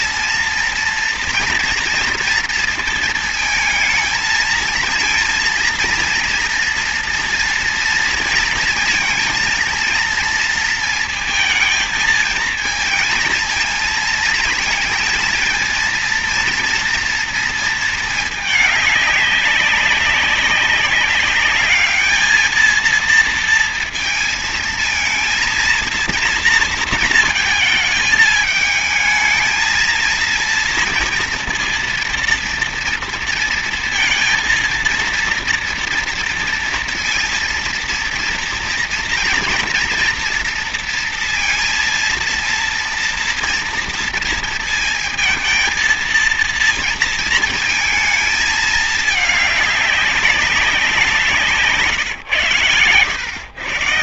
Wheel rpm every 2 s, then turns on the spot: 230, 230, 230, 230, 230, 230, 220, 230, 230, 210, 200, 220, 230, 230, 220, 230, 230, 230, 230, 230, 240, 230, 230, 230, 220, 190, 120.
none